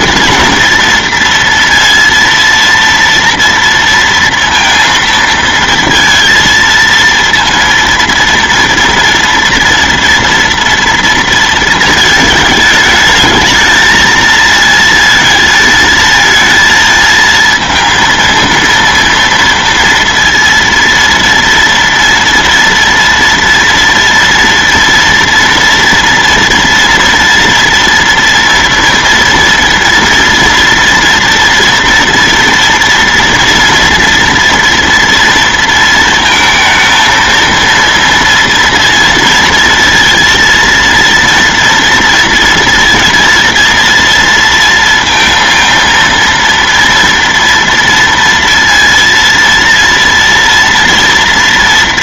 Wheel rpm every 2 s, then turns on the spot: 230, 230, 230, 230, 230, 230, 210, 230, 220, 230, 230, 240, 240, 230, 230, 230, 230, 230, 230, 240, 230, 230, 230, 230, 230, 240.
none